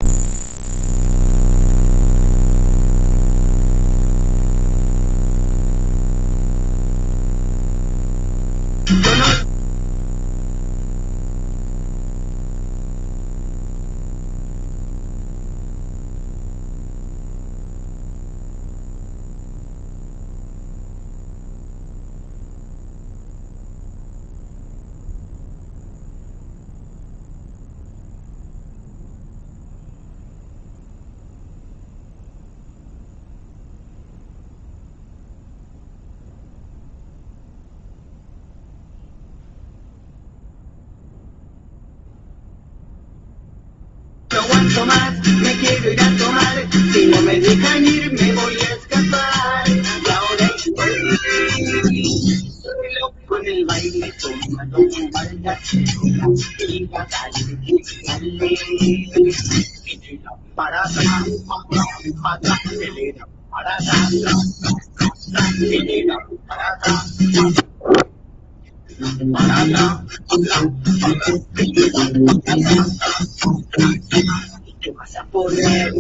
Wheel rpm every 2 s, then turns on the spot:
0, 0, 0, 0, 0, 0, 0, 0, 0, 0, 0, 0, 0, 0, 0, 0, 0, 0, 0, 0, 0, 0, 0, 0, 0, 0, 0, 0, 0, 0, 0, 0, 0, 0, 0, 0, 0, 0.
none